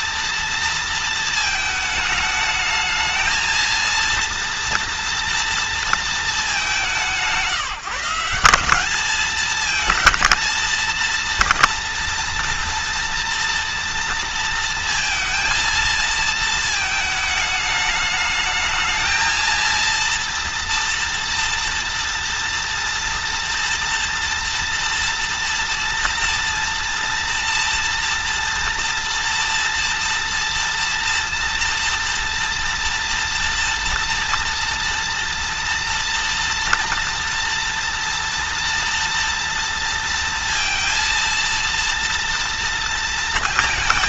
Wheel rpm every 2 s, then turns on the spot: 230, 220, 230, 190, 200, 230, 230, 230, 220, 220, 240, 230, 230, 230, 230, 230, 230, 230, 230, 230, 230, 230.
none